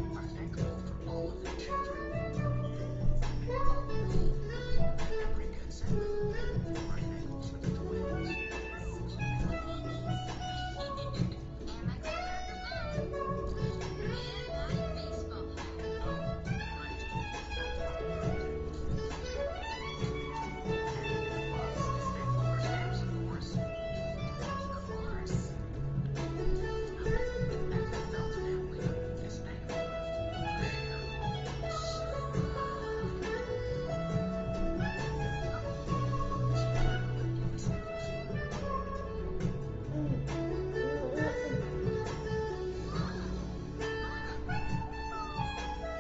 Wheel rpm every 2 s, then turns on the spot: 0, 0, 0, 0, 0, 0, 0, 0, 0, 0, 0, 0, 0, 0, 0, 0, 0, 0, 0, 0, 0, 0, 0.
none